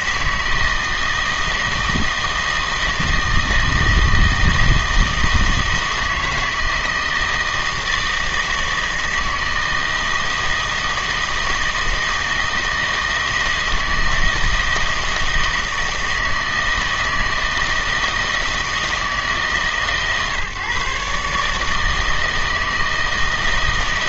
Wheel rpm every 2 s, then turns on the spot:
160, 160, 160, 160, 160, 160, 160, 160, 160, 160, 140, 160.
none